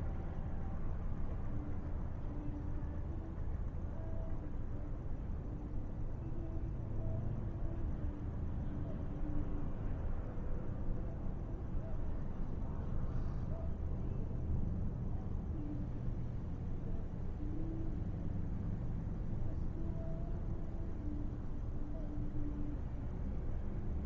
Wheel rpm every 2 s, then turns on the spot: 0, 0, 0, 0, 0, 0, 0, 0, 0, 0, 0, 0.
none